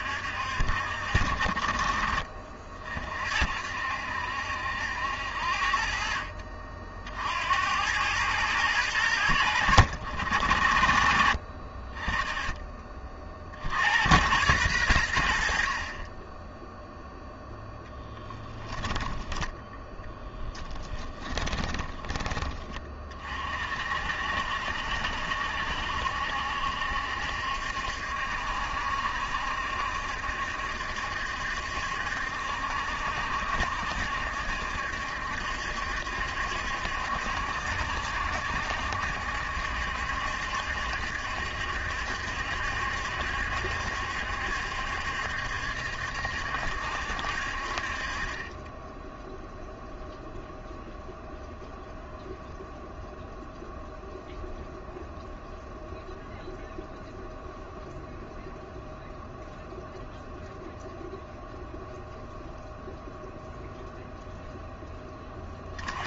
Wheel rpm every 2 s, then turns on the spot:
60, 50, 80, 60, 100, 60, 30, 80, 0, 10, 20, 40, 70, 70, 70, 70, 70, 70, 70, 70, 70, 70, 70, 70, 10, 0, 0, 0, 0, 0, 0, 0, 10.
20-22